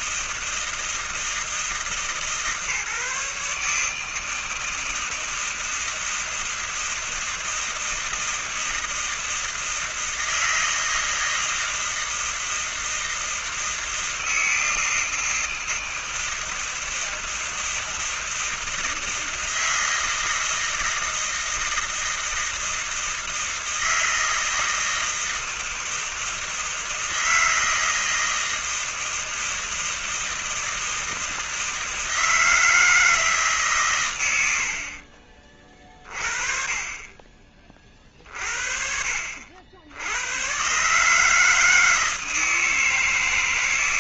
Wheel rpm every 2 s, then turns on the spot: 160, 150, 160, 160, 160, 160, 160, 160, 160, 160, 160, 160, 160, 160, 160, 160, 160, 70, 30, 50, 120, 160.
none